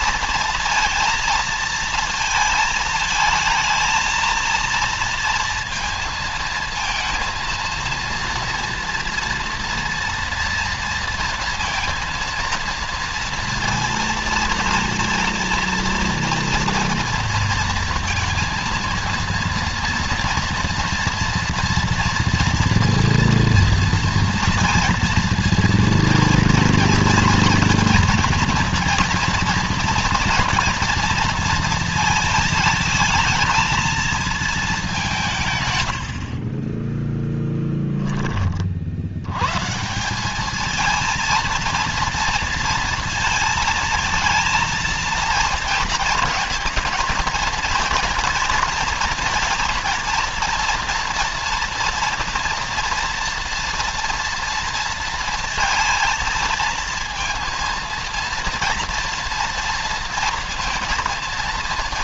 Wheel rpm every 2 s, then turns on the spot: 230, 220, 230, 230, 230, 230, 230, 230, 230, 230, 230, 230, 230, 230, 230, 230, 220, 210, 30, 40, 220, 230, 230, 230, 230, 230, 230, 230, 230, 230, 230.
36-38